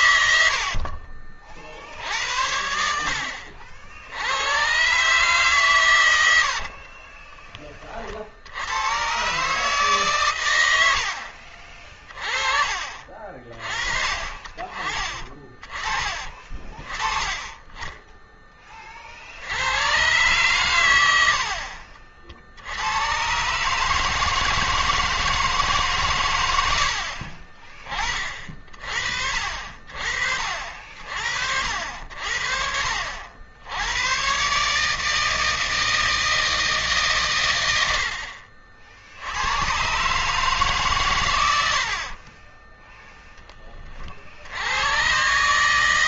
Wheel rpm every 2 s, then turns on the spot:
80, 80, 110, 60, 90, 110, 40, 30, 30, 20, 120, 60, 160, 100, 50, 50, 70, 130, 160, 60, 140, 20, 80.
0-2 6-8 42-44